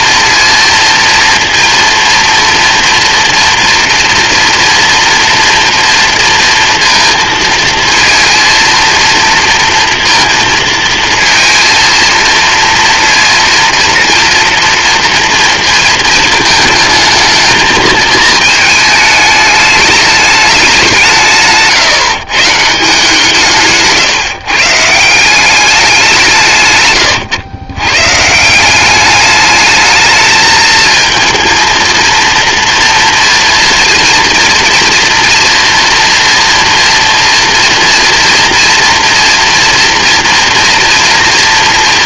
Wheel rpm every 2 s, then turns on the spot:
230, 230, 230, 230, 230, 230, 230, 230, 220, 220, 200, 150, 140, 160, 170, 220, 240, 240, 230, 230, 230.
none